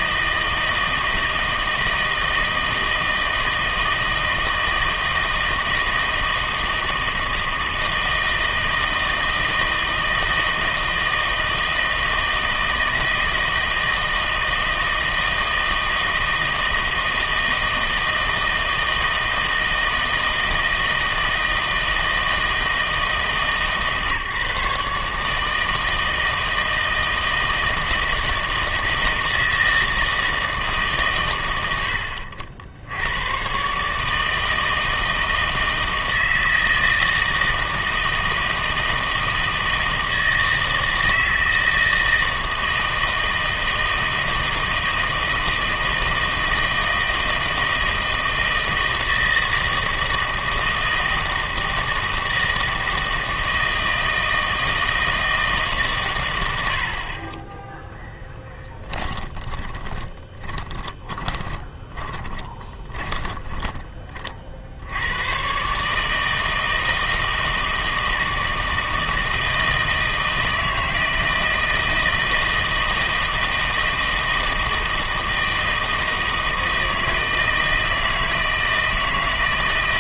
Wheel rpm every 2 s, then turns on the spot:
160, 160, 160, 160, 160, 160, 160, 160, 160, 160, 160, 160, 150, 160, 160, 160, 70, 160, 160, 160, 160, 160, 160, 160, 160, 160, 160, 160, 70, 10, 20, 20, 60, 160, 160, 160, 160, 160, 160, 160.
58-64